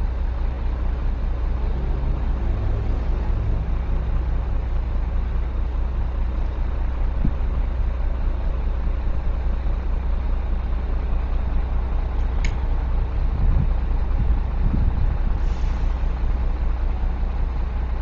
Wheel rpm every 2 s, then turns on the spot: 0, 0, 0, 0, 0, 0, 0, 0, 0.
none